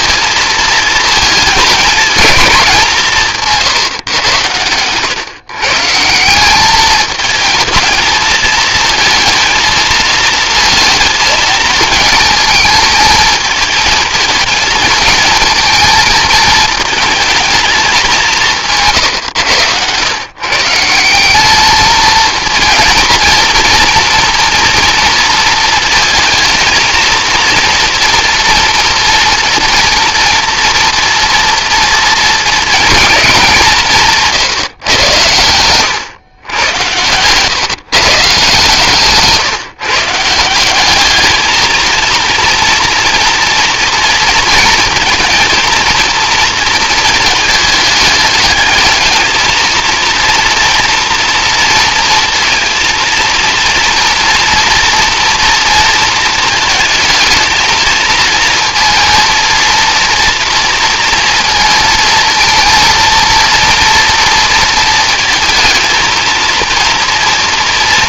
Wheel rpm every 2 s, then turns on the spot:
230, 190, 110, 200, 220, 230, 220, 220, 220, 150, 170, 230, 230, 230, 230, 230, 220, 130, 110, 150, 200, 230, 230, 220, 210, 240, 230, 230, 220, 230, 230, 230, 230, 230.
none